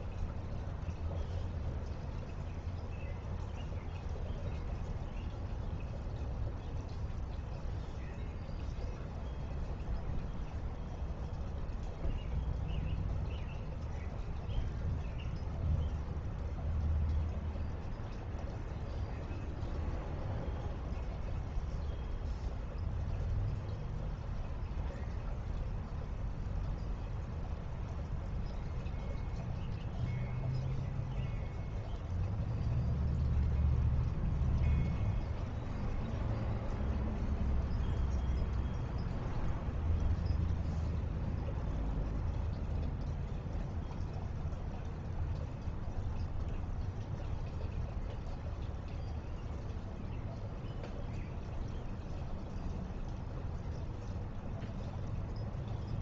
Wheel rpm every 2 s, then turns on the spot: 0, 0, 0, 0, 0, 0, 0, 0, 0, 0, 0, 0, 0, 0, 0, 0, 0, 0, 0, 0, 0, 0, 0, 0, 0, 0, 0, 0.
none